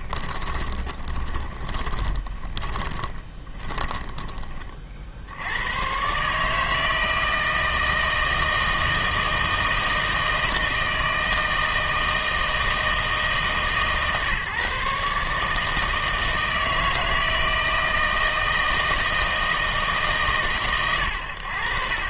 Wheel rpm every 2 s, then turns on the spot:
20, 30, 30, 150, 160, 160, 160, 150, 160, 160, 120.
0-4